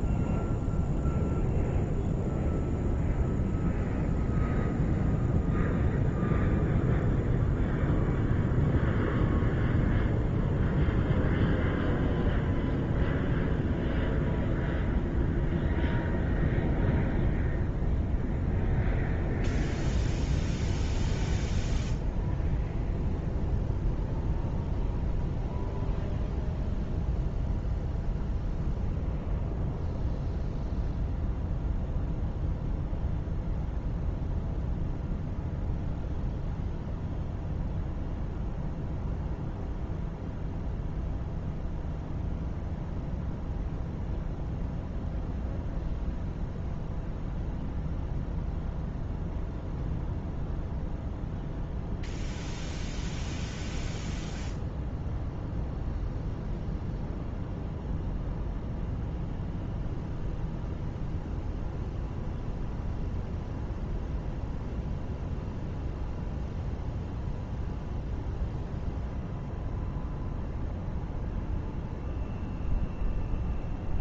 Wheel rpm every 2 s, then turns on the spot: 0, 0, 0, 0, 0, 0, 0, 0, 0, 0, 0, 0, 0, 0, 0, 0, 0, 0, 0, 0, 0, 0, 0, 0, 0, 0, 0, 0, 0, 0, 0, 0, 0, 0, 0, 0, 0.
none